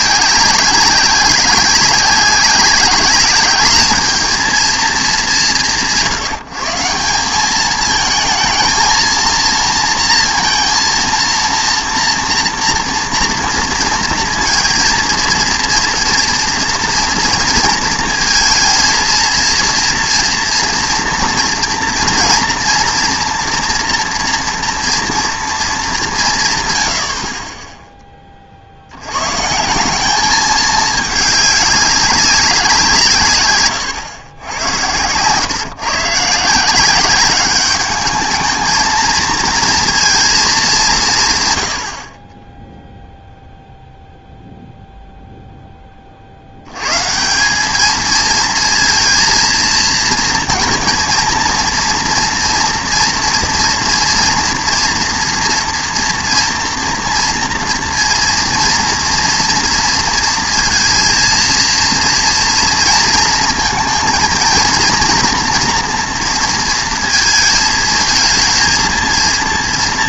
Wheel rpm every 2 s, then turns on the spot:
190, 200, 220, 160, 220, 230, 230, 230, 240, 230, 230, 230, 240, 120, 60, 210, 190, 110, 170, 220, 200, 10, 0, 90, 230, 230, 230, 230, 230, 230, 230, 230, 230, 230, 230.
none